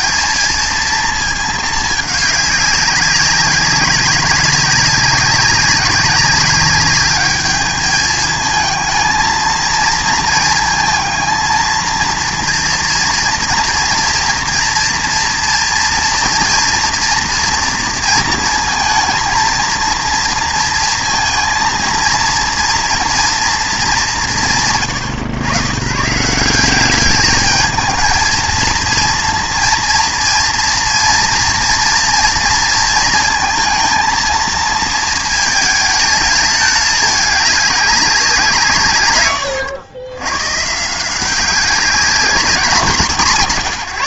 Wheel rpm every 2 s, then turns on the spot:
230, 200, 190, 200, 220, 220, 230, 230, 230, 230, 230, 230, 150, 180, 220, 230, 230, 230, 220, 160, 140, 200.
none